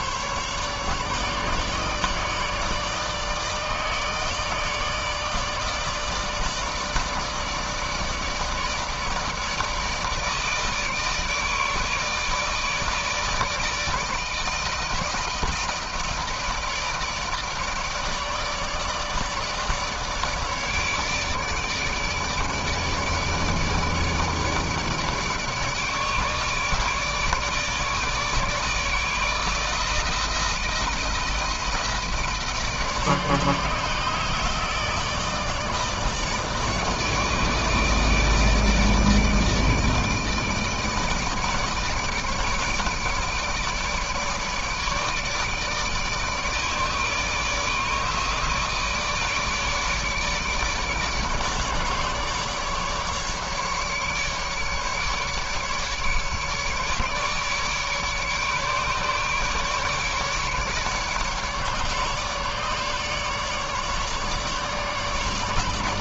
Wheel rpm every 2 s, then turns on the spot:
150, 150, 150, 160, 160, 150, 150, 160, 160, 150, 150, 150, 150, 150, 160, 160, 150, 160, 150, 150, 150, 150, 150, 150, 160, 150, 150, 150, 150, 150, 150, 150, 150.
none